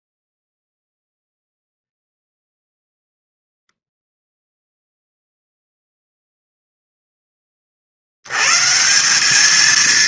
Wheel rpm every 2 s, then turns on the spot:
0, 0, 0, 0, 170.
none